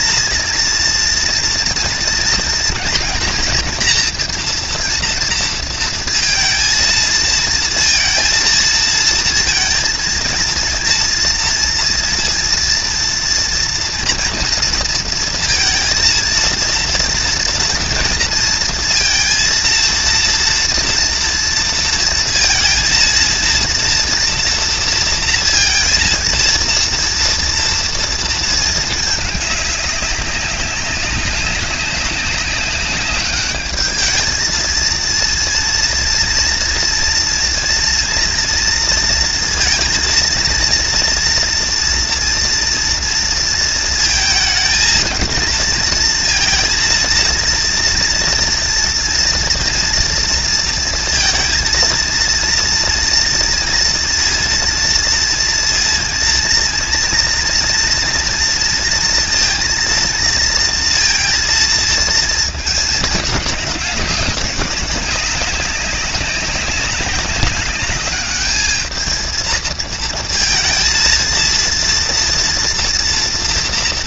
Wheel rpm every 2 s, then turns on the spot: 230, 230, 240, 230, 230, 230, 230, 230, 230, 230, 230, 230, 230, 230, 220, 200, 200, 230, 230, 240, 230, 230, 230, 230, 230, 230, 230, 230, 230, 230, 230, 220, 190, 200, 220, 230, 230.
none